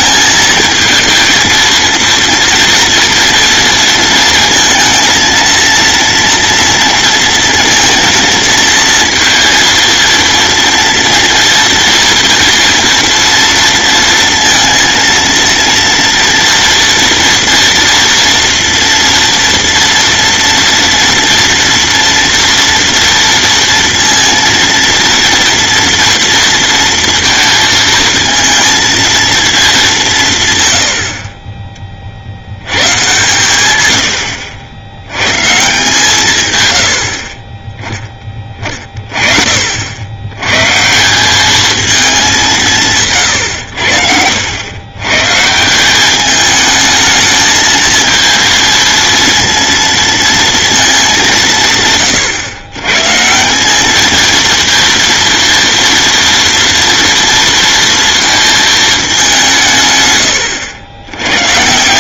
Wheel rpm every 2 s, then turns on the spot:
220, 240, 230, 230, 230, 230, 230, 230, 230, 230, 230, 230, 230, 230, 230, 100, 110, 90, 100, 30, 140, 150, 110, 220, 230, 220, 120, 230, 240, 220, 90.
none